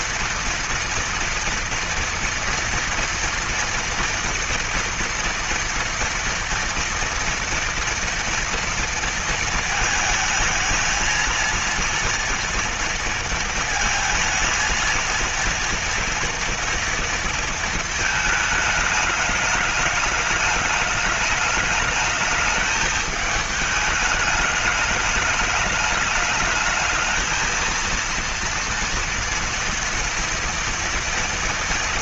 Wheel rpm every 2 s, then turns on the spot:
230, 230, 240, 230, 230, 220, 230, 230, 230, 220, 210, 210, 210, 210, 230, 230.
none